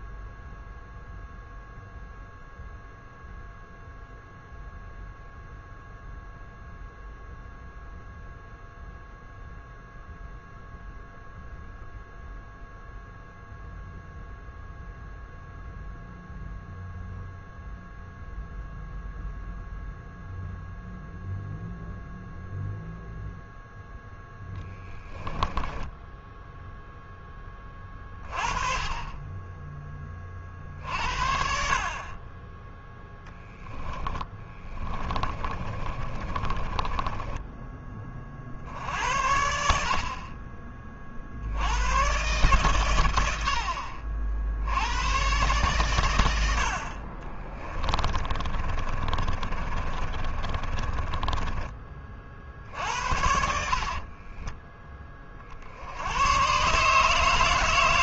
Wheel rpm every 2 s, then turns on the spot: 0, 0, 0, 0, 0, 0, 0, 0, 0, 0, 0, 0, 10, 0, 30, 40, 20, 30, 20, 40, 40, 110, 80, 70, 30, 30, 50, 20, 120.
32-38 48-54